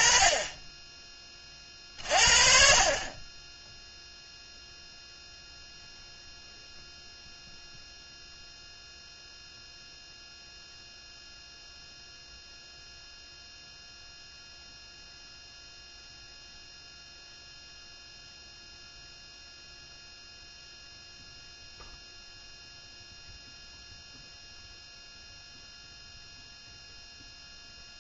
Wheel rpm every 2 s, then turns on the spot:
20, 40, 0, 0, 0, 0, 0, 0, 0, 0, 0, 0, 0, 0.
none